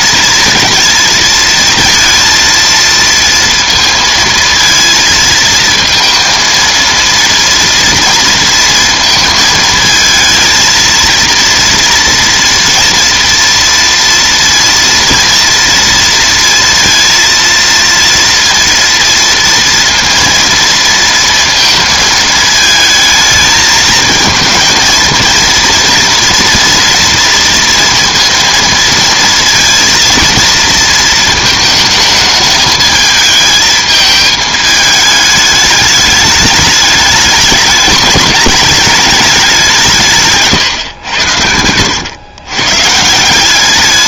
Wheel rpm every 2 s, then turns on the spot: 230, 230, 230, 230, 230, 230, 230, 230, 230, 230, 230, 220, 220, 230, 230, 230, 220, 220, 210, 210, 120, 130.
none